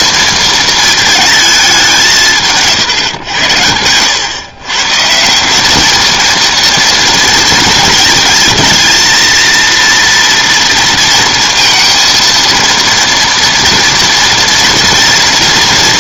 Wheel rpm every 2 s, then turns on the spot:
220, 150, 130, 230, 220, 230, 230, 230.
none